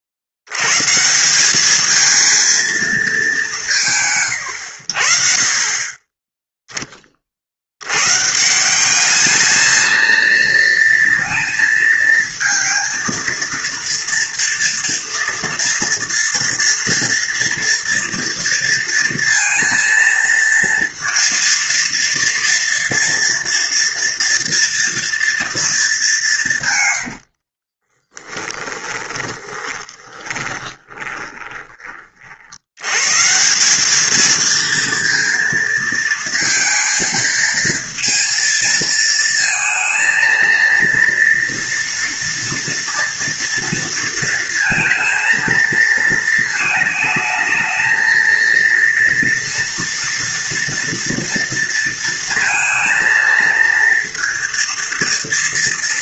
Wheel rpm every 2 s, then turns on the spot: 70, 220, 100, 10, 160, 230, 230, 230, 240, 230, 230, 230, 230, 160, 10, 20, 80, 230, 230, 230, 230, 230, 230, 220, 230, 230, 230, 230.
26-32